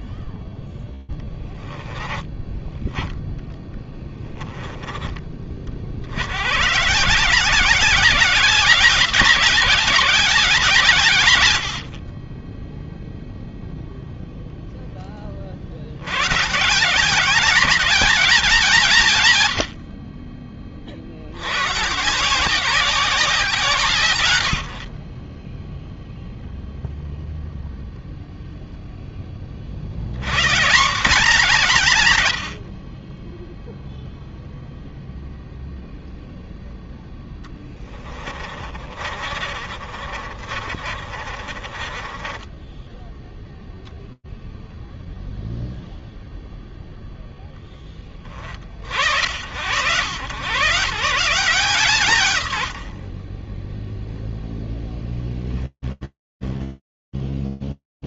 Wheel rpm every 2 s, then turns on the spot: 10, 20, 160, 200, 120, 0, 10, 150, 180, 20, 180, 120, 0, 0, 70, 140, 0, 0, 10, 50, 40, 10, 0, 10, 100, 140, 0, 10, 0.
36-42